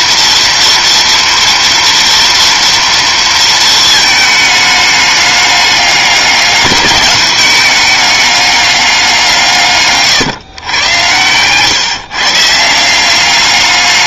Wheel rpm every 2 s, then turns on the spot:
230, 230, 210, 200, 200, 120, 180.
none